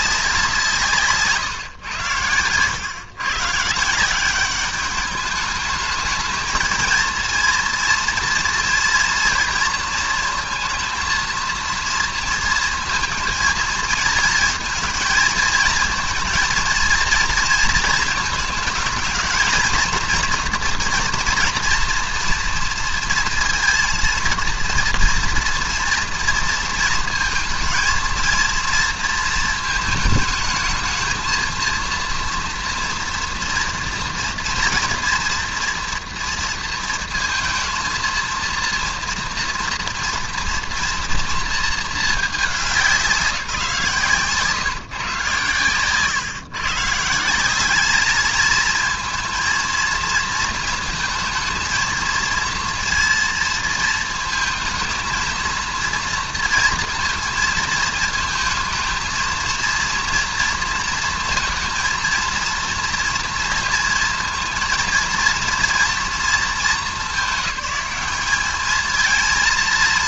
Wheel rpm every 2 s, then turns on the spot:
160, 110, 200, 230, 230, 230, 230, 230, 230, 220, 240, 230, 230, 230, 230, 220, 230, 240, 230, 240, 230, 200, 140, 140, 220, 230, 230, 220, 230, 230, 230, 230, 230, 190, 210.
none